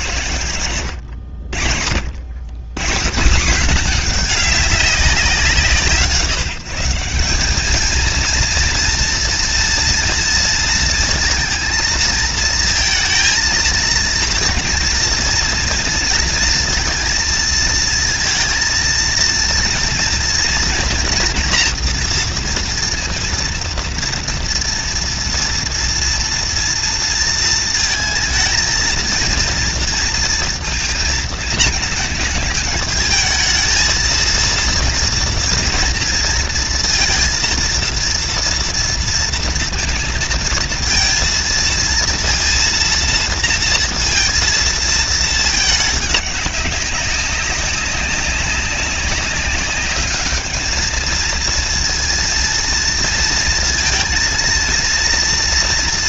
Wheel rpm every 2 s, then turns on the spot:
60, 190, 170, 210, 230, 230, 230, 230, 230, 230, 230, 230, 230, 230, 230, 220, 220, 230, 230, 230, 230, 230, 210, 190, 200, 230, 230, 230.
none